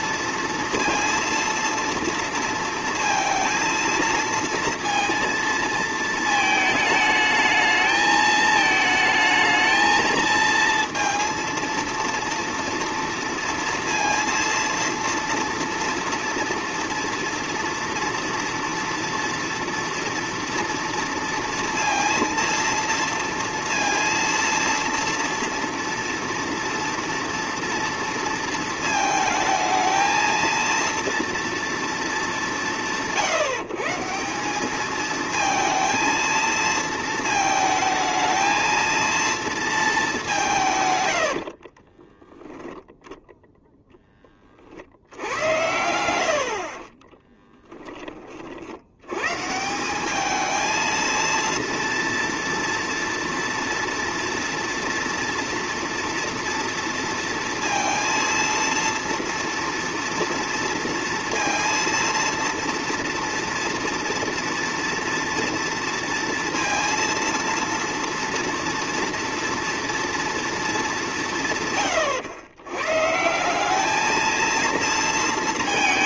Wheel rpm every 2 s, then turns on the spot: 230, 230, 230, 220, 220, 230, 230, 230, 230, 230, 230, 230, 230, 230, 230, 230, 150, 190, 230, 220, 180, 0, 20, 80, 30, 220, 230, 230, 230, 230, 230, 230, 240, 230, 230, 230, 110, 220.
46-48